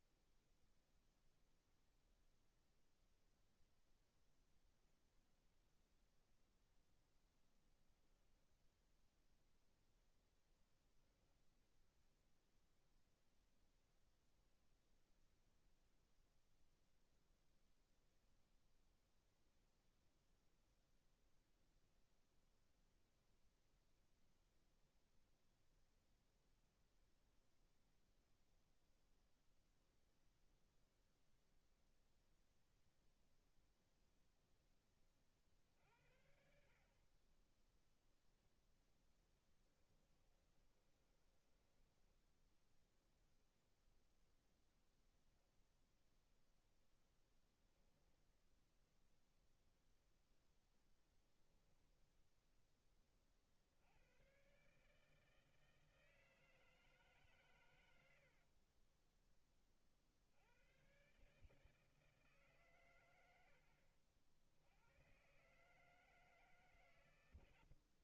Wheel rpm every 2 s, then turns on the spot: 0, 0, 0, 10, 0, 0, 0, 0, 0, 0, 0, 0, 0, 0, 0, 0, 0, 40, 40, 10, 20, 0, 0, 0, 0, 10, 30, 150, 150, 30, 130, 110, 110, 130.
40-42 50-52 58-60